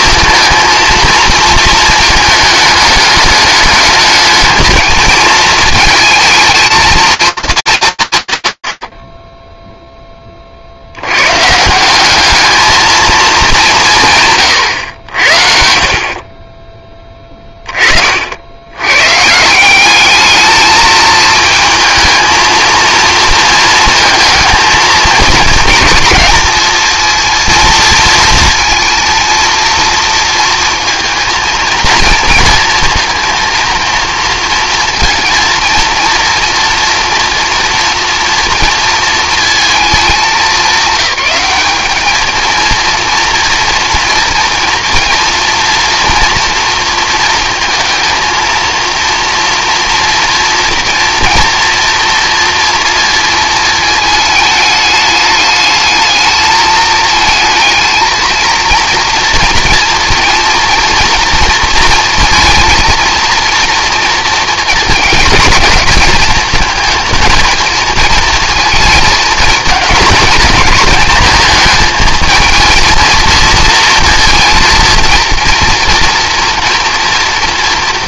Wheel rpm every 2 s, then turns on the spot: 230, 220, 220, 220, 120, 50, 220, 120, 30, 120, 220, 230, 220, 220, 230, 230, 230, 230, 240, 230, 200, 230, 230, 230, 230, 240, 230, 210, 220, 230, 230, 230, 230, 220, 220, 220, 230, 230, 230.
none